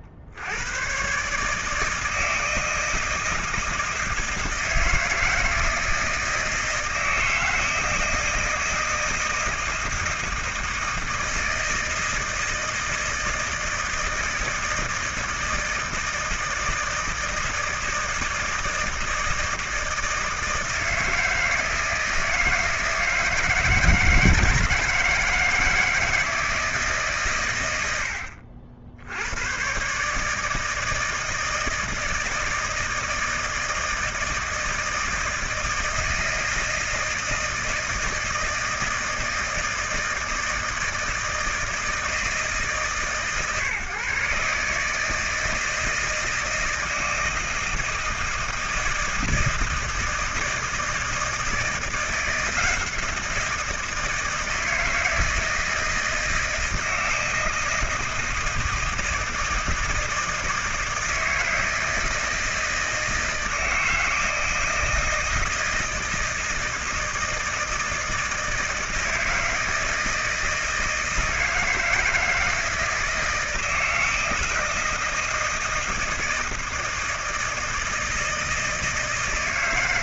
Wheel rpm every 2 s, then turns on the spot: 60, 160, 170, 160, 160, 160, 160, 160, 160, 160, 160, 160, 160, 160, 70, 150, 160, 160, 160, 160, 160, 150, 140, 160, 160, 160, 170, 160, 160, 160, 160, 160, 160, 160, 160, 160, 160, 160, 160, 160.
none